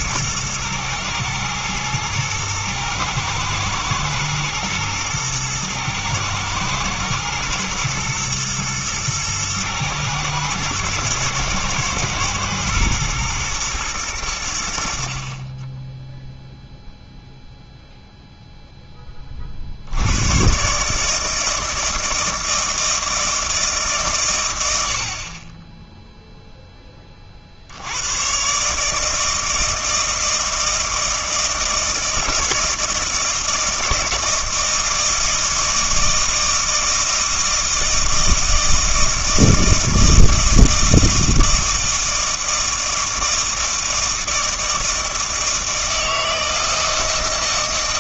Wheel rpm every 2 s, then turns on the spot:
110, 110, 120, 110, 110, 110, 110, 70, 0, 10, 140, 160, 80, 10, 150, 160, 160, 160, 160, 160, 160, 160, 160, 160.
none